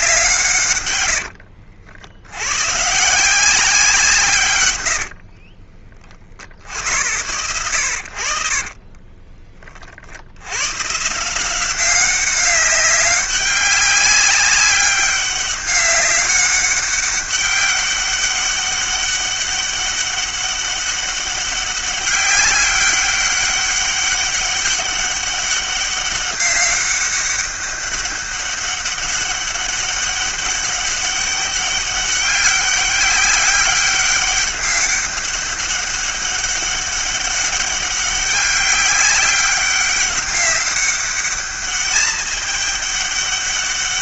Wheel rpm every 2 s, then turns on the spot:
120, 130, 110, 70, 40, 110, 190, 200, 200, 200, 200, 200, 200, 200, 200, 200, 200, 200, 200, 200, 200, 210.
4-6 8-10